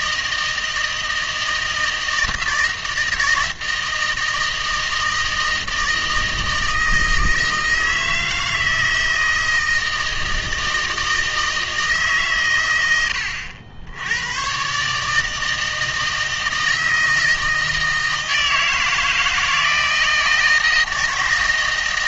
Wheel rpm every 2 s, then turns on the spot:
160, 160, 160, 160, 160, 160, 100, 140, 160, 160, 160.
none